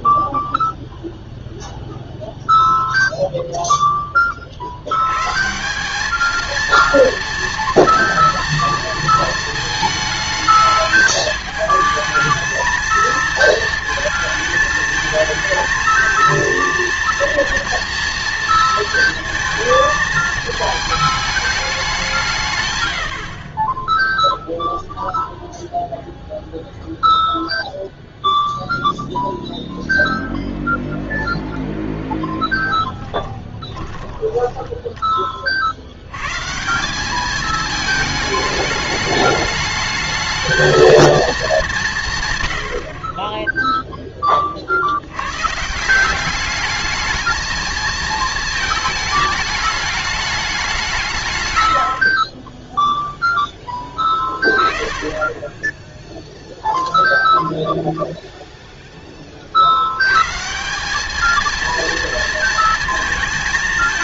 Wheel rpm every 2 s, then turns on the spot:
0, 0, 50, 230, 230, 220, 220, 220, 230, 230, 220, 130, 0, 0, 0, 0, 10, 10, 150, 210, 220, 100, 40, 210, 220, 200, 20, 20, 0, 0, 170, 230.
32-36